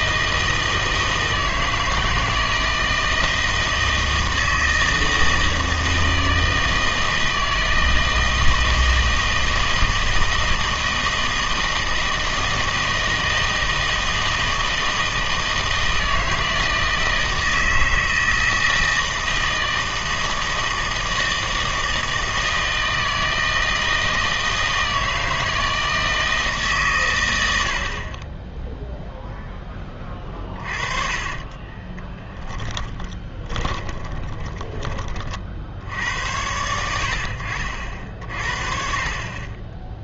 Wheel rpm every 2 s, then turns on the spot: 160, 160, 160, 160, 160, 160, 160, 160, 160, 160, 160, 160, 160, 150, 10, 30, 10, 20, 80, 40.
30-36